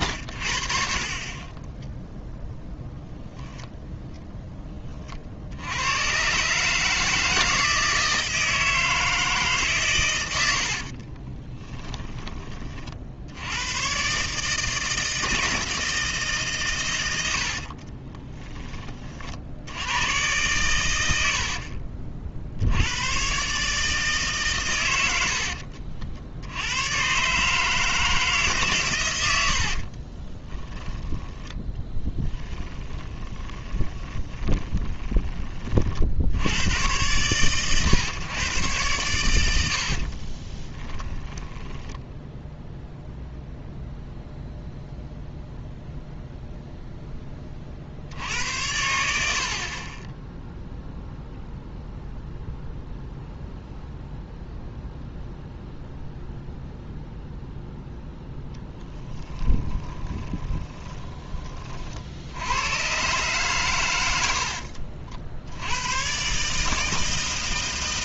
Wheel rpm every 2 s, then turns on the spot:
90, 40, 20, 70, 160, 90, 40, 160, 140, 20, 110, 80, 120, 90, 130, 20, 10, 20, 100, 120, 20, 0, 0, 0, 90, 0, 0, 0, 0, 10, 20, 100, 60, 150.
32-36 40-42 58-62